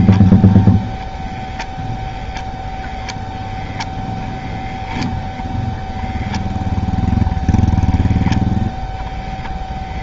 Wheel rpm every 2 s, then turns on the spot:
0, 0, 0, 0, 0.
none